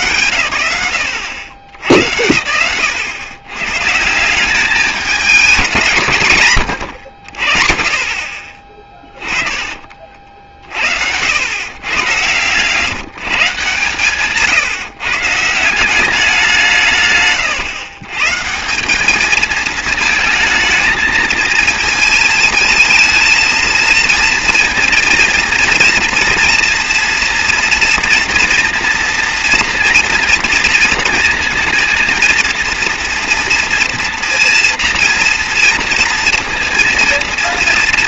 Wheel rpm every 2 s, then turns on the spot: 110, 100, 200, 120, 30, 60, 140, 150, 160, 180, 220, 220, 230, 230, 240, 230, 230, 240, 230.
8-10